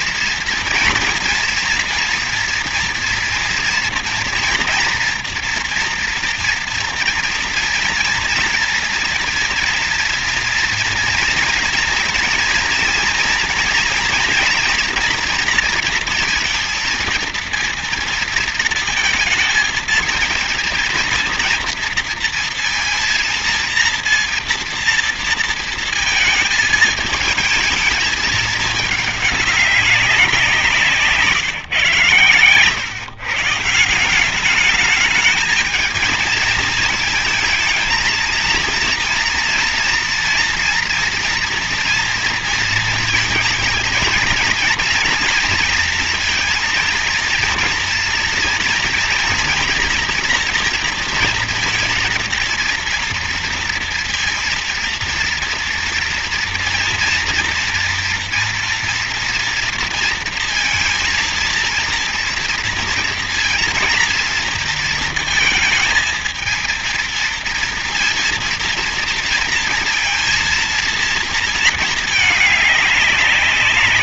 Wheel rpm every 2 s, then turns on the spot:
230, 230, 240, 230, 230, 230, 230, 240, 230, 230, 230, 230, 230, 220, 220, 180, 120, 190, 220, 230, 230, 230, 230, 230, 230, 230, 230, 230, 230, 230, 230, 230, 230, 230, 230, 230, 210.
none